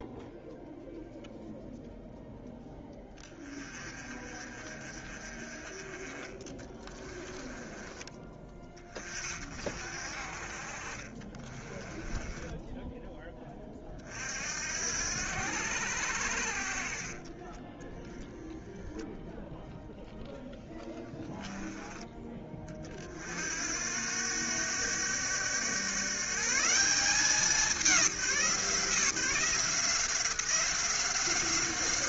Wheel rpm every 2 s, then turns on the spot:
0, 10, 30, 20, 30, 30, 10, 70, 40, 0, 10, 40, 100, 180, 170, 180.
6-8 10-12